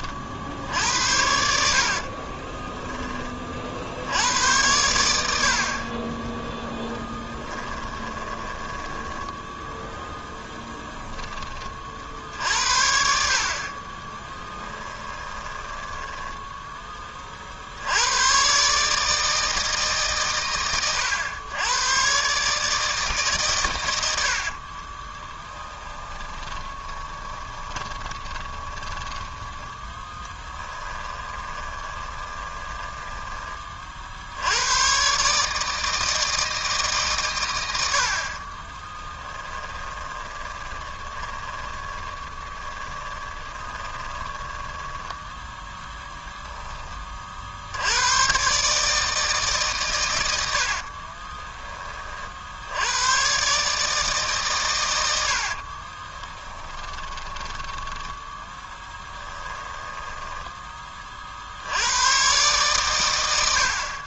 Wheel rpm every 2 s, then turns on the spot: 70, 10, 100, 10, 20, 10, 60, 10, 10, 140, 110, 150, 40, 20, 20, 10, 10, 110, 160, 30, 20, 20, 10, 10, 140, 60, 90, 110, 20, 10, 20, 110.
2-4 8-10 14-16 24-34 38-44 50-52 56-60